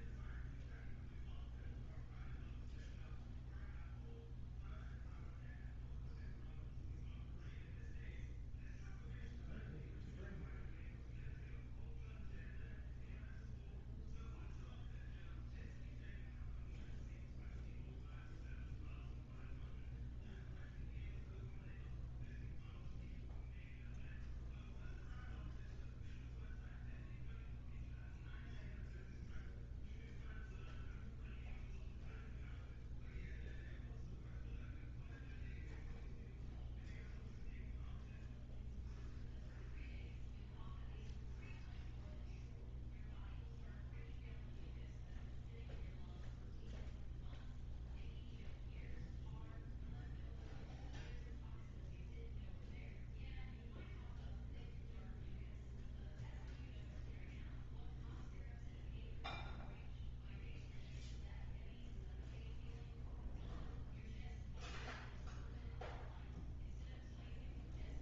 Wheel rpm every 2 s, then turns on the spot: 0, 0, 0, 0, 0, 0, 0, 0, 0, 0, 0, 0, 0, 0, 0, 0, 0, 0, 0, 0, 0, 0, 0, 0, 0, 0, 0, 0, 0, 0, 0, 0, 0, 0.
none